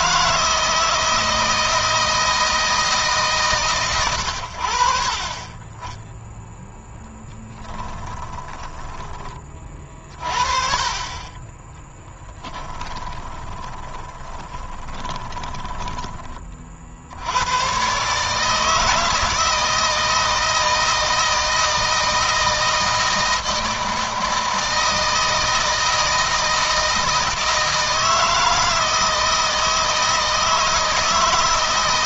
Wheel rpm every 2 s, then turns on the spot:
160, 160, 50, 10, 20, 40, 20, 10, 60, 160, 160, 160, 160, 160, 160, 160.
6-8 12-16